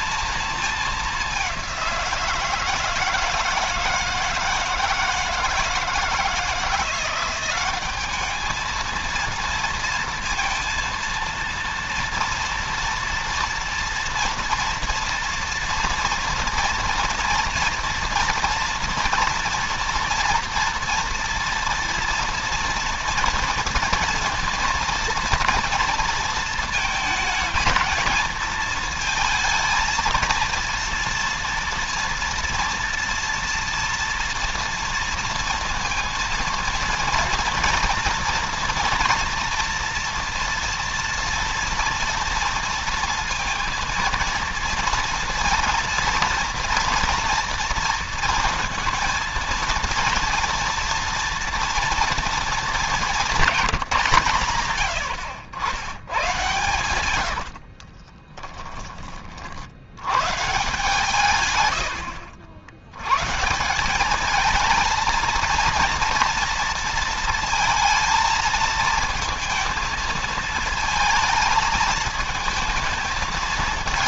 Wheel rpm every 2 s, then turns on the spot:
210, 160, 160, 180, 220, 230, 230, 230, 230, 230, 230, 230, 230, 230, 220, 230, 230, 230, 240, 240, 240, 230, 230, 230, 230, 230, 200, 90, 110, 30, 140, 100, 220, 230, 230, 220, 220.
54-58